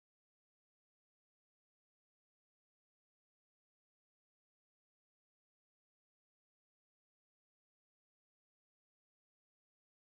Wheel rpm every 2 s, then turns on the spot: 0, 0, 0, 0, 0.
none